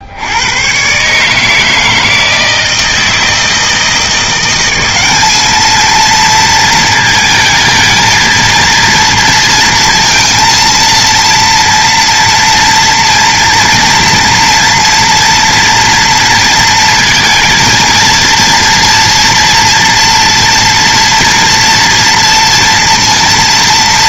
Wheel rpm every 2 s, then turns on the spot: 110, 160, 190, 230, 230, 230, 230, 230, 230, 230, 240, 230.
none